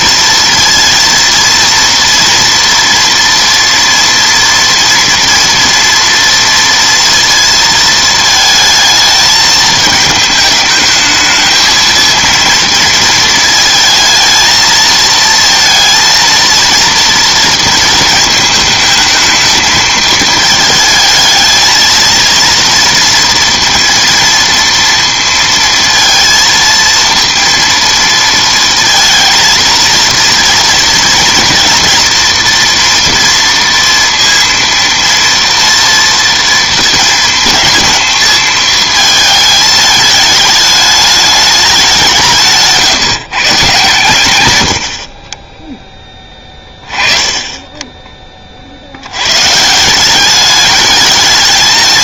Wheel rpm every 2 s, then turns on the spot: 230, 230, 230, 230, 220, 220, 230, 220, 230, 220, 220, 230, 230, 230, 230, 230, 240, 230, 230, 220, 210, 160, 90, 20, 50, 210.
none